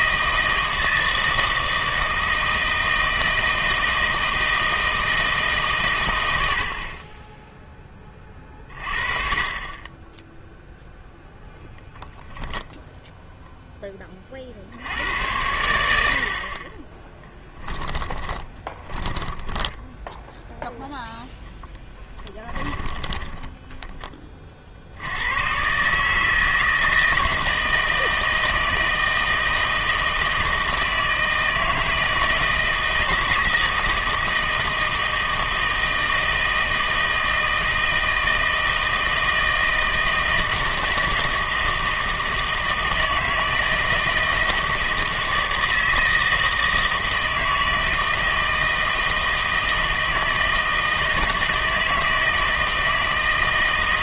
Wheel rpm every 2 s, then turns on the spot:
160, 160, 160, 60, 30, 0, 10, 60, 30, 20, 0, 20, 50, 160, 160, 160, 160, 160, 160, 160, 160, 160, 160, 160, 160, 160, 160.
16-20 22-24